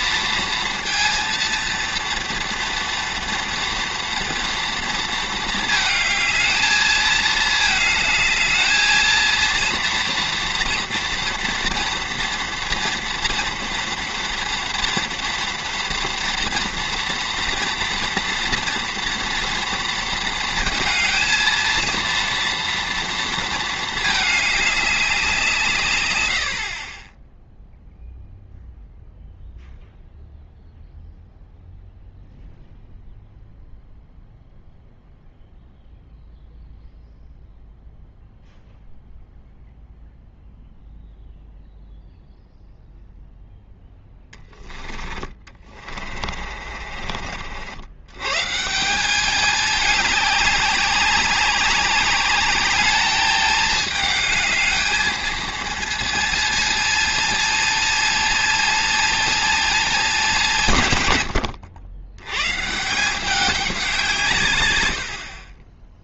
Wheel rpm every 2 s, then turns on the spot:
230, 230, 230, 220, 220, 230, 230, 230, 230, 230, 220, 240, 210, 50, 0, 0, 0, 0, 0, 0, 0, 0, 10, 30, 150, 200, 200, 210, 220, 220, 160, 150, 110.
44-48